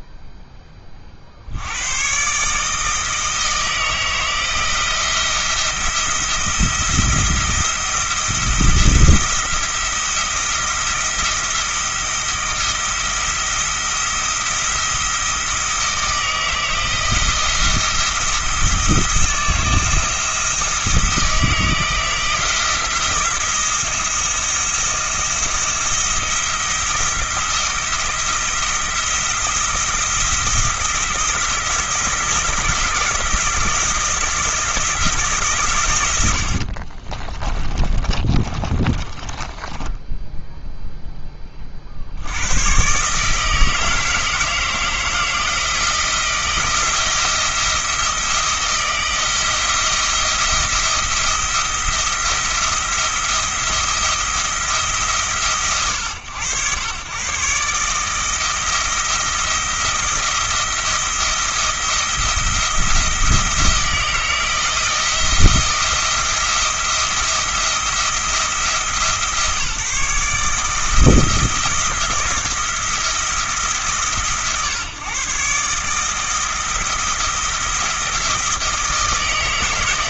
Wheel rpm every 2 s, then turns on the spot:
10, 150, 160, 170, 170, 170, 170, 170, 160, 170, 170, 170, 170, 170, 170, 170, 170, 170, 50, 20, 0, 110, 160, 170, 170, 170, 170, 150, 100, 170, 170, 170, 170, 170, 160, 160, 170, 120, 170, 170.
36-40